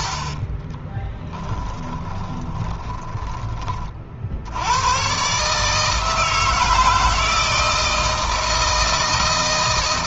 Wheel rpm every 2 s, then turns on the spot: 20, 10, 100, 160, 160.
0-4